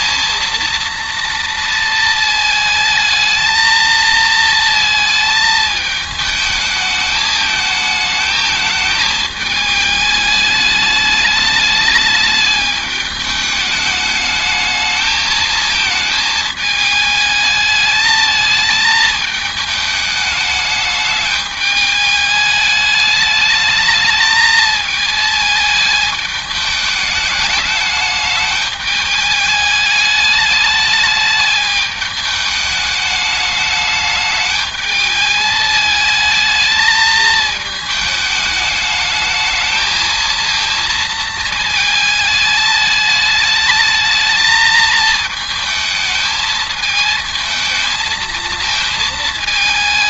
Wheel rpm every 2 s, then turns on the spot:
230, 220, 220, 220, 220, 210, 210, 220, 210, 220, 210, 210, 220, 210, 210, 210, 210, 210, 220, 220, 220, 220, 220, 220, 220.
none